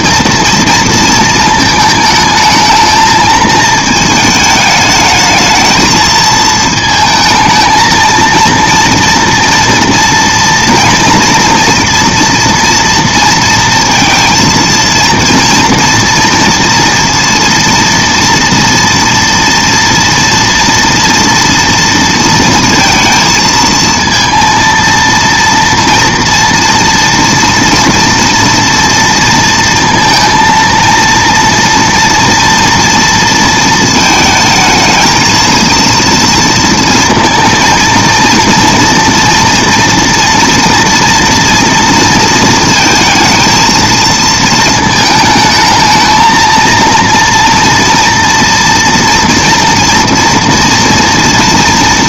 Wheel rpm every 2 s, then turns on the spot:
230, 220, 210, 220, 230, 230, 230, 230, 230, 230, 240, 230, 230, 230, 230, 230, 230, 220, 230, 240, 230, 220, 220, 230, 230, 230.
none